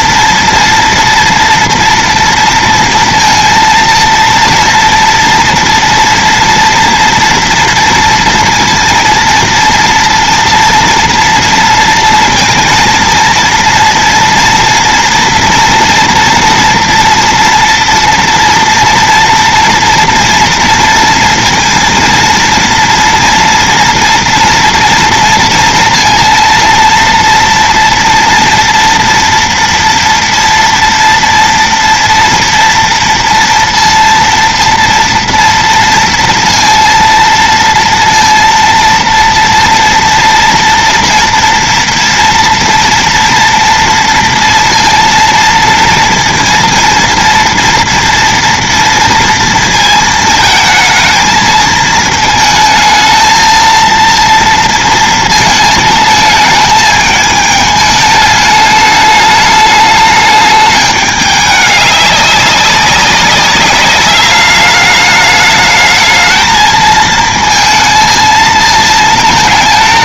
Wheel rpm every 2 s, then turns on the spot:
230, 230, 230, 230, 230, 230, 230, 230, 240, 230, 230, 230, 230, 230, 230, 230, 230, 230, 230, 230, 240, 230, 230, 230, 230, 220, 220, 230, 220, 210, 210, 190, 200, 220, 220.
none